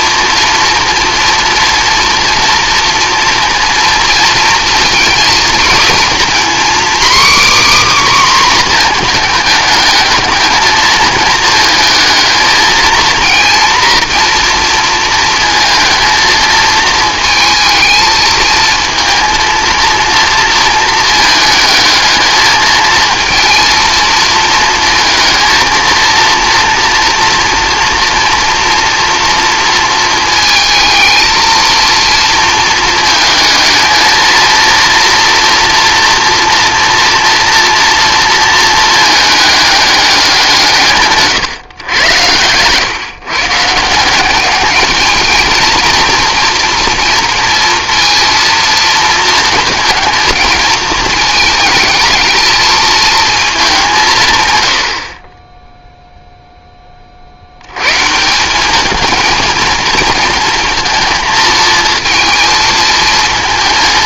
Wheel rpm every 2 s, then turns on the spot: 230, 230, 230, 260, 250, 220, 220, 230, 220, 220, 230, 220, 230, 230, 240, 220, 220, 230, 230, 220, 160, 120, 210, 230, 230, 220, 220, 120, 10, 200, 230, 230.
none